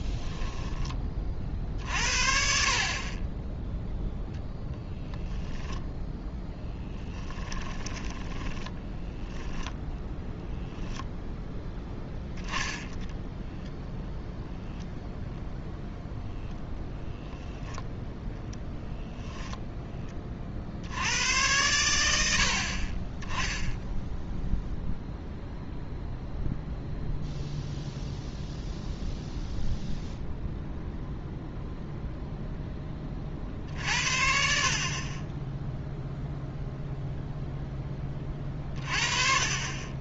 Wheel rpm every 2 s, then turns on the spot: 40, 0, 0, 10, 0, 0, 0, 0, 0, 0, 100, 10, 0, 0, 0, 0, 30, 20, 0, 30.
6-8